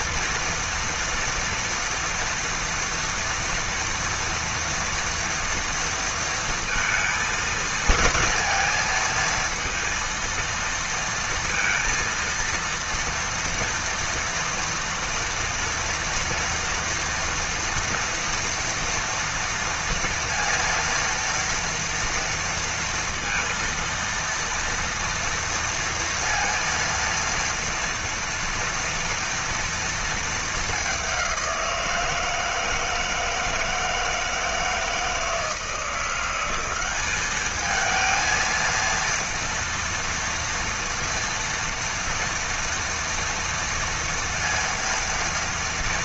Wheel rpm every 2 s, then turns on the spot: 230, 230, 230, 230, 230, 230, 230, 230, 230, 230, 230, 230, 230, 230, 230, 230, 170, 160, 180, 220, 230, 230, 230.
none